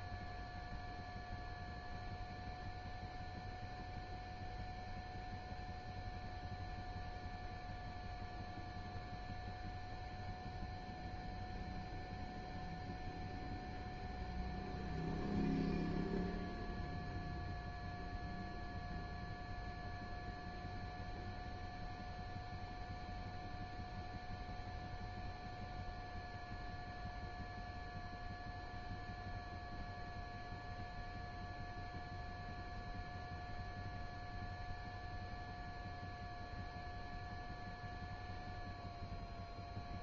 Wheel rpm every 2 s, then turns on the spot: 0, 0, 0, 0, 0, 0, 0, 0, 0, 0, 0, 0, 0, 0, 0, 0, 0, 0, 0, 0.
none